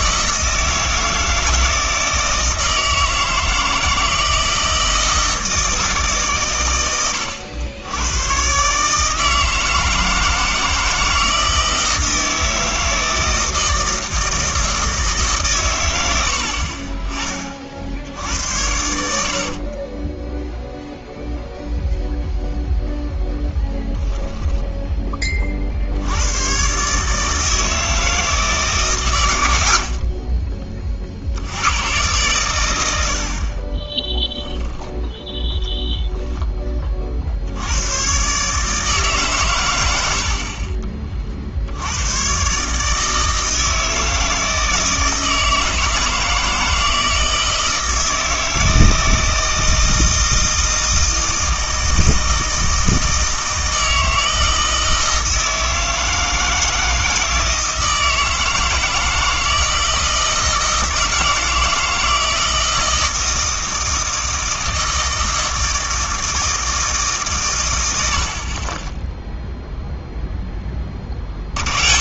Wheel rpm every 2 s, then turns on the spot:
160, 160, 160, 110, 140, 160, 160, 160, 50, 80, 0, 0, 10, 130, 150, 20, 110, 10, 20, 150, 40, 130, 160, 160, 160, 160, 160, 160, 160, 160, 160, 160, 160, 160, 30, 20.
68-70